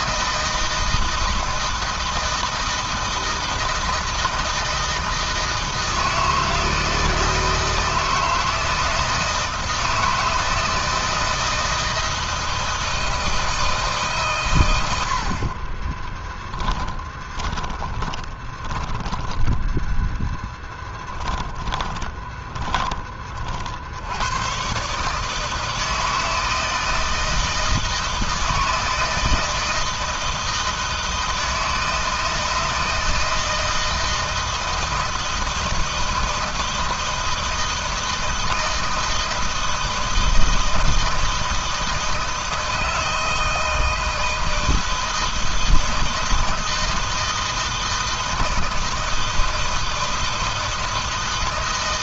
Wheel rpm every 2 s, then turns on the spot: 160, 160, 160, 160, 160, 160, 160, 120, 10, 10, 10, 20, 110, 160, 160, 160, 160, 160, 160, 160, 160, 160, 160, 160, 160, 160.
16-24